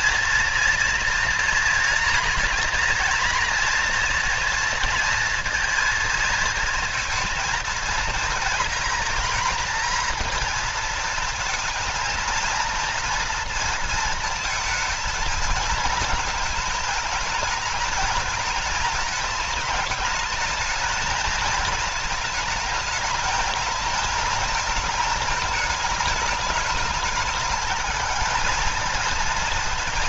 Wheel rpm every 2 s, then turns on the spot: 230, 230, 230, 230, 230, 230, 230, 230, 220, 220, 220, 220, 220, 220, 220.
none